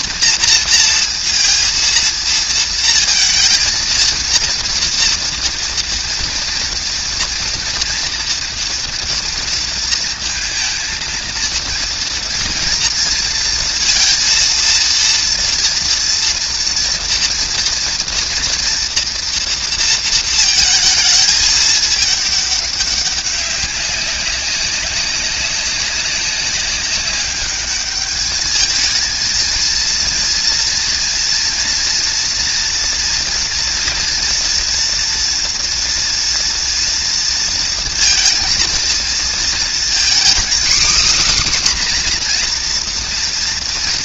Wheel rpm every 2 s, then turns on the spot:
230, 230, 230, 230, 230, 230, 230, 230, 230, 230, 220, 210, 190, 200, 210, 230, 230, 230, 230, 230, 260, 250.
none